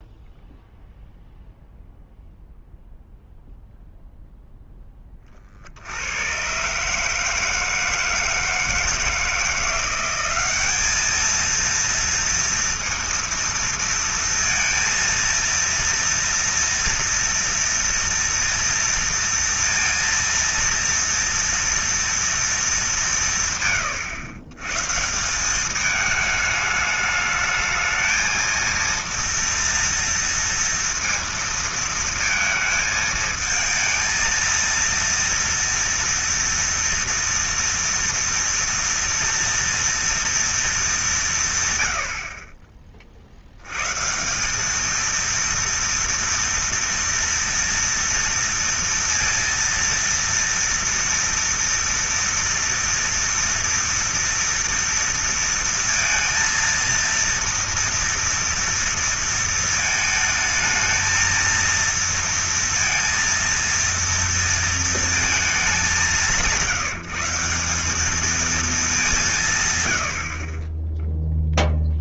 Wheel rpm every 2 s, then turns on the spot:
0, 0, 10, 130, 160, 200, 230, 230, 230, 230, 230, 220, 130, 210, 230, 230, 220, 230, 230, 230, 220, 40, 200, 230, 230, 230, 230, 230, 230, 230, 220, 230, 230, 170, 210, 30.
none